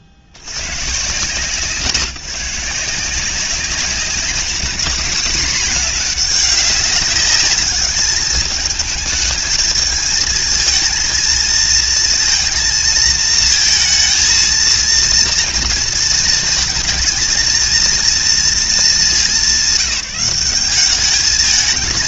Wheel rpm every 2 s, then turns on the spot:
40, 150, 210, 210, 210, 220, 230, 230, 230, 220, 190.
none